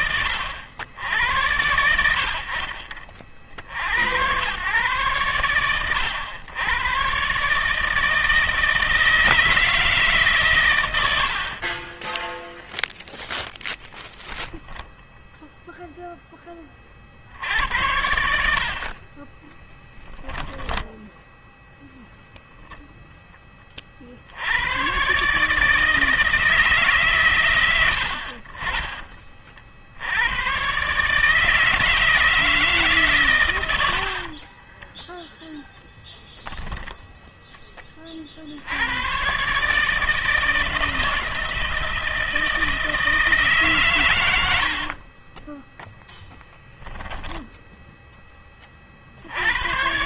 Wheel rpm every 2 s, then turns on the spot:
80, 50, 110, 120, 160, 90, 0, 0, 40, 40, 10, 0, 120, 140, 30, 140, 150, 30, 0, 100, 160, 160, 40, 10, 40.
10-12 18-22 34-36 44-48